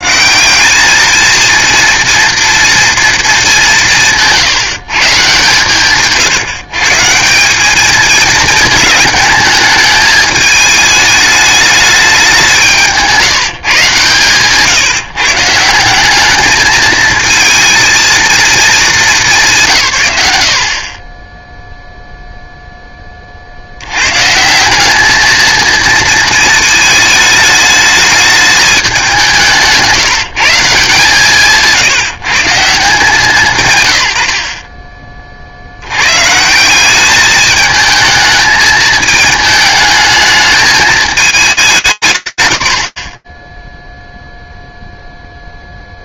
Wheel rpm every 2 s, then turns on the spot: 210, 230, 150, 150, 220, 210, 170, 150, 220, 210, 30, 20, 200, 220, 190, 160, 170, 30, 200, 220, 210, 100, 0.
12-14